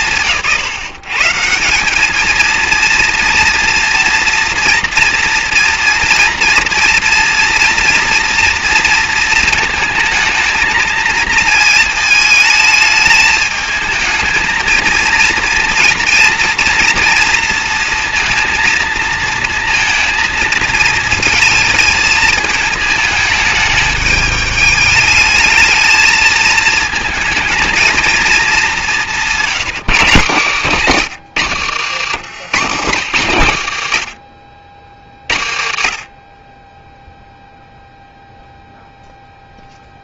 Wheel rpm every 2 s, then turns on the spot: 140, 230, 240, 230, 230, 220, 210, 230, 230, 230, 220, 220, 210, 220, 200, 140, 140, 40, 0, 0.
none